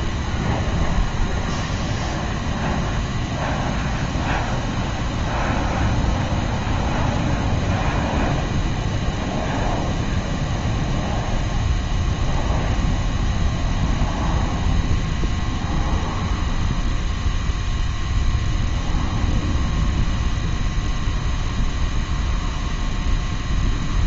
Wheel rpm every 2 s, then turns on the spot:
0, 0, 0, 0, 0, 0, 0, 0, 0, 0, 0, 0.
none